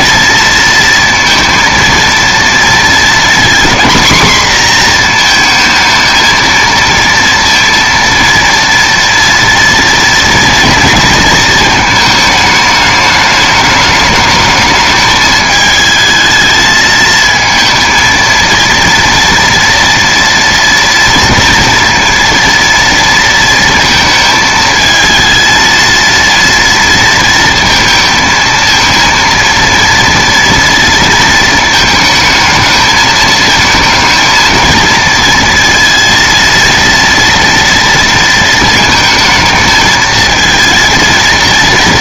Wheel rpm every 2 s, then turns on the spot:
230, 230, 240, 230, 230, 230, 210, 210, 220, 230, 240, 230, 220, 230, 230, 230, 220, 230, 230, 220, 220.
none